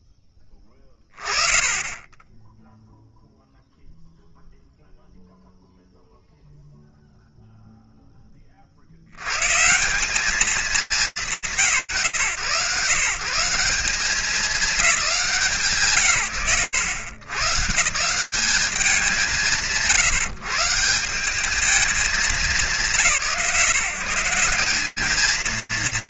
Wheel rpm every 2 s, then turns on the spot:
10, 0, 0, 0, 150, 170, 180, 190, 130, 170, 170, 160, 210.
none